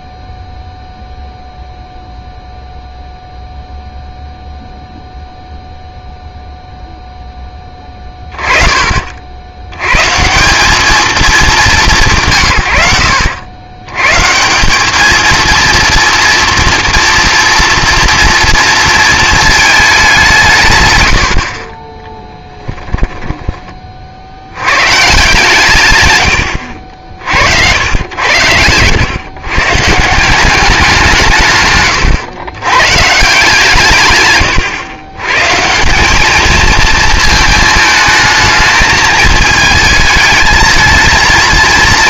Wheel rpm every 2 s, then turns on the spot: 0, 0, 0, 0, 40, 190, 100, 180, 230, 230, 130, 10, 100, 80, 110, 180, 120, 120, 220, 220, 220.
22-24 34-36